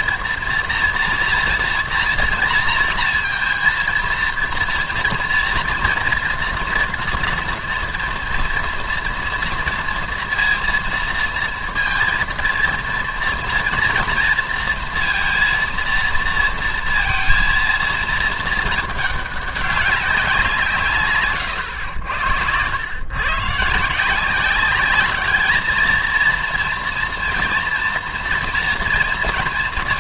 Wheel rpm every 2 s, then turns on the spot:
230, 230, 230, 230, 230, 230, 230, 230, 230, 220, 160, 100, 190, 240, 230.
none